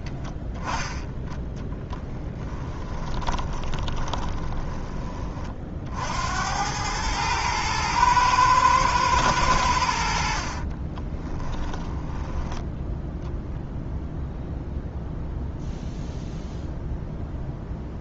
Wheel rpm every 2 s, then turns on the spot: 10, 20, 20, 100, 110, 30, 10, 0, 0.
0-4 10-12